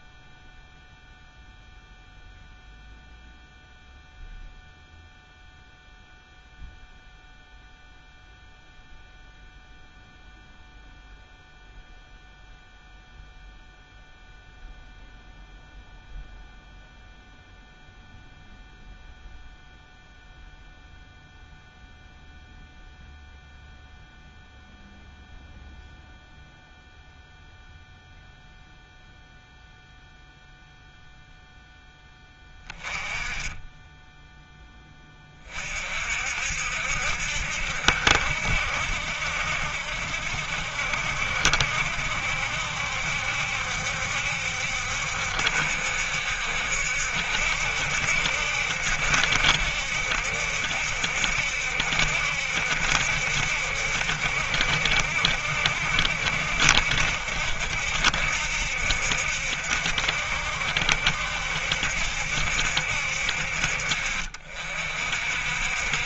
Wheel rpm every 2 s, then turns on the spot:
0, 0, 0, 0, 0, 0, 0, 0, 0, 0, 0, 0, 0, 0, 0, 0, 20, 10, 60, 70, 70, 70, 70, 70, 70, 70, 70, 70, 70, 70, 70, 70, 50.
none